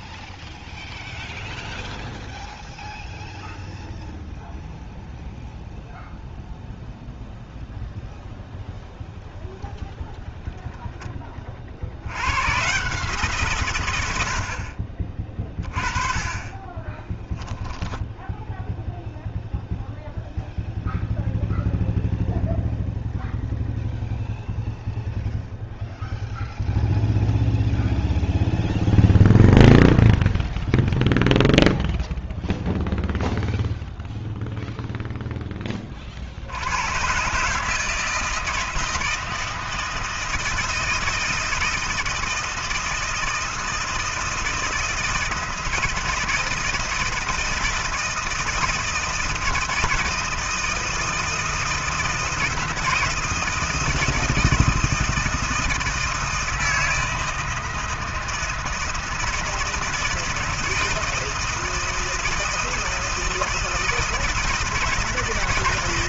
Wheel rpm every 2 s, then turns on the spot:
0, 0, 0, 0, 0, 20, 110, 70, 20, 0, 0, 0, 0, 0, 0, 0, 0, 0, 70, 160, 160, 160, 160, 160, 160, 160, 160, 160, 160, 160, 160, 160, 160.
16-18